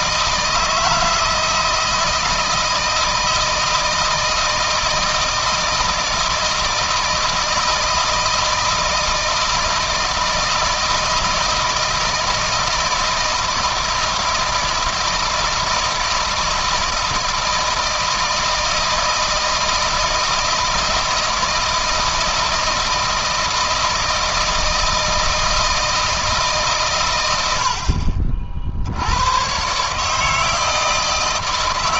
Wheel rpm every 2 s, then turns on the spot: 160, 160, 160, 160, 160, 160, 160, 160, 160, 160, 170, 160, 160, 120, 70, 160.
none